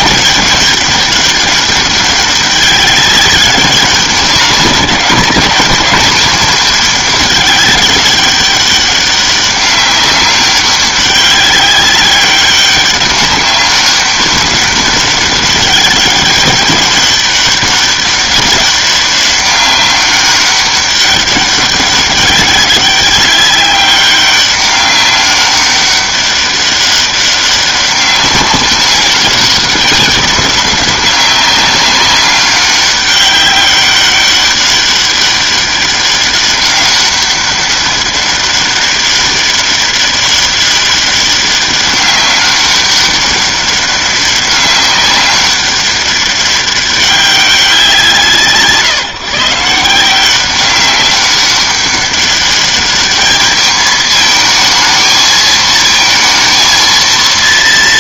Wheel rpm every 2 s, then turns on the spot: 200, 200, 200, 210, 200, 200, 200, 200, 200, 200, 200, 190, 190, 200, 200, 190, 200, 200, 200, 200, 200, 190, 200, 200, 150, 190, 210, 220, 230.
none